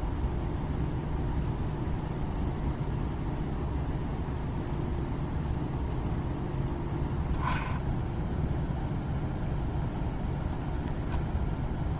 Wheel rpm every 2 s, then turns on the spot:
0, 0, 0, 0, 0, 0.
none